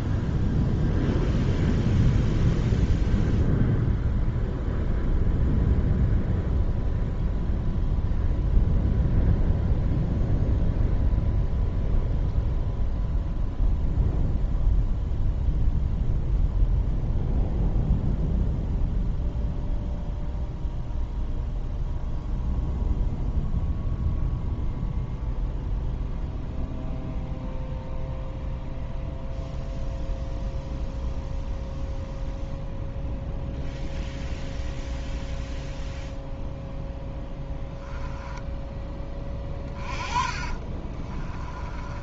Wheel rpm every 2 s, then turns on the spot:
0, 0, 0, 0, 0, 0, 0, 0, 0, 0, 0, 0, 0, 0, 0, 0, 0, 0, 0, 20, 30.
38-42